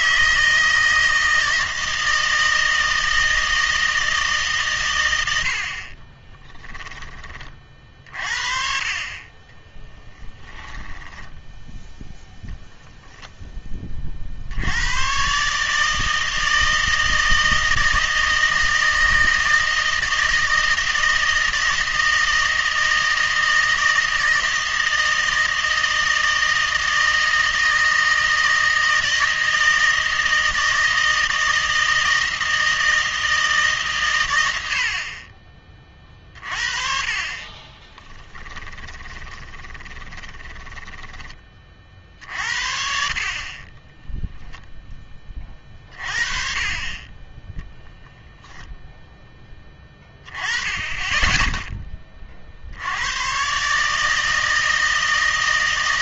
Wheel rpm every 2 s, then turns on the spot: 160, 160, 130, 10, 40, 10, 0, 80, 160, 160, 160, 160, 160, 160, 160, 160, 160, 70, 40, 30, 20, 50, 0, 30, 0, 20, 60, 160.
6-8 38-42